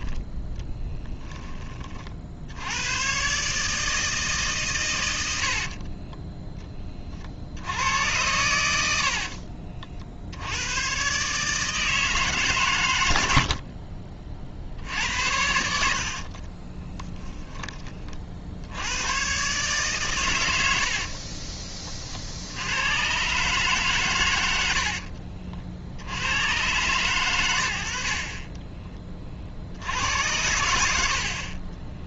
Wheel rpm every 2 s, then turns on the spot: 10, 90, 120, 20, 80, 110, 110, 70, 30, 100, 70, 100, 70, 120, 30, 80.
0-2 16-18 20-22 24-26